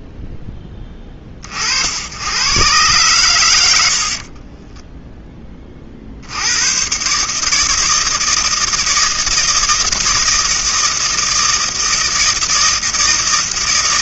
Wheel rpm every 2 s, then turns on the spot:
20, 100, 10, 110, 160, 160, 160.
none